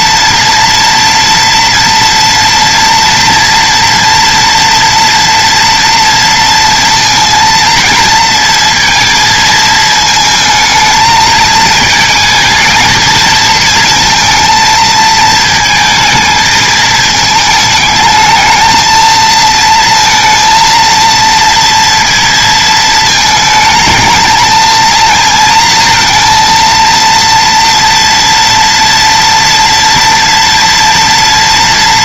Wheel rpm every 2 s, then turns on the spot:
240, 230, 230, 230, 230, 220, 220, 230, 220, 220, 230, 220, 220, 230, 230, 230.
none